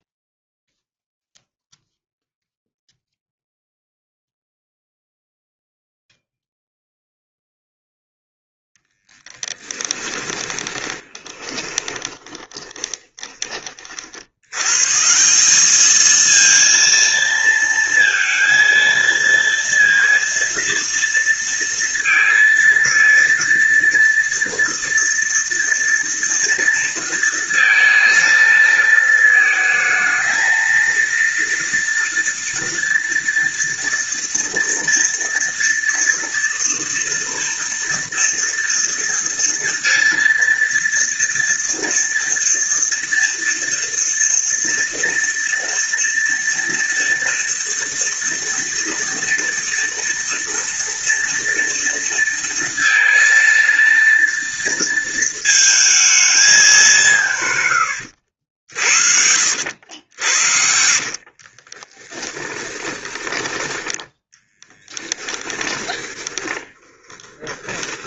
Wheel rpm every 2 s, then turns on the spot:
0, 0, 0, 0, 0, 20, 20, 130, 230, 230, 230, 230, 230, 230, 220, 230, 230, 230, 230, 230, 230, 230, 230, 230, 230, 230, 230, 230, 190, 60, 60, 20, 20, 10.
10-14 58-62 64-68